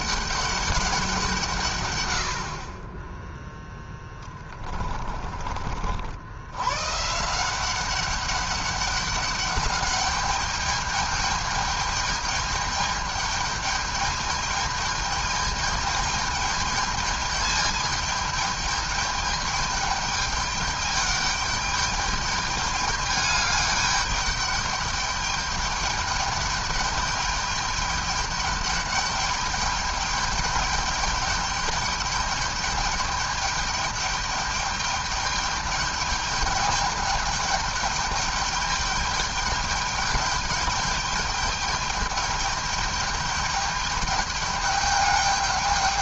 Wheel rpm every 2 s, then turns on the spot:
200, 60, 20, 110, 200, 210, 210, 210, 210, 210, 210, 210, 210, 210, 210, 210, 210, 210, 210, 210, 210, 210, 210.
4-6